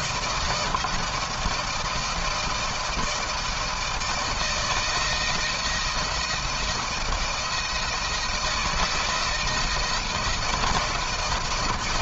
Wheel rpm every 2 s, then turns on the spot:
160, 160, 160, 160, 160, 170.
none